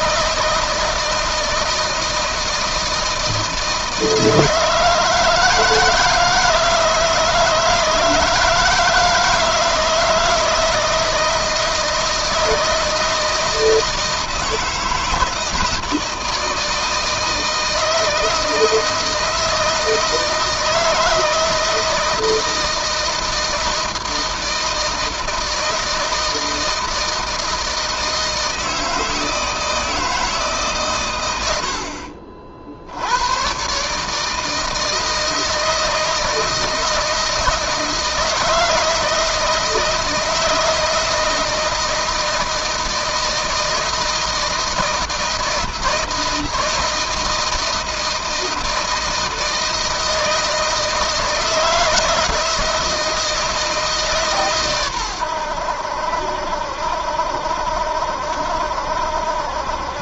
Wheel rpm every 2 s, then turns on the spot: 160, 160, 160, 160, 170, 160, 160, 160, 160, 160, 160, 160, 160, 160, 160, 150, 60, 160, 160, 160, 160, 160, 160, 160, 160, 160, 170, 140, 70, 70.
none